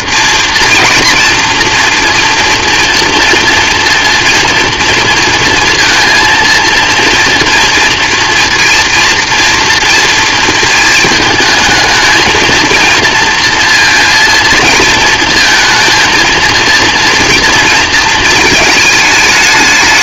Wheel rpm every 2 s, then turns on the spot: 230, 230, 230, 230, 240, 220, 230, 230, 230, 220.
none